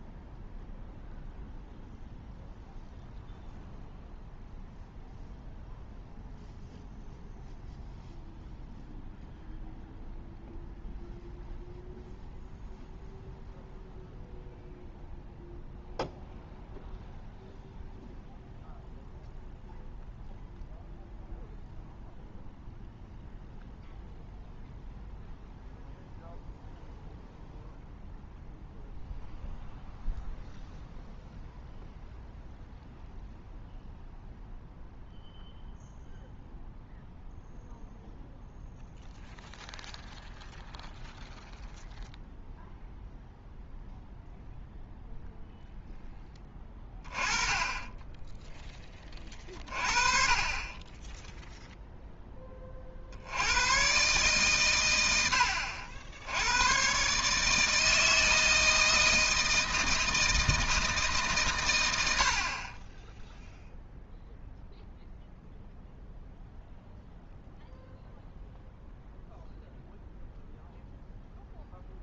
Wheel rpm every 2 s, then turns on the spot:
0, 0, 0, 0, 0, 0, 0, 0, 0, 0, 0, 0, 0, 0, 0, 0, 0, 0, 0, 0, 0, 0, 0, 20, 10, 30, 30, 120, 100, 160, 160, 40, 0, 0, 0, 0.
none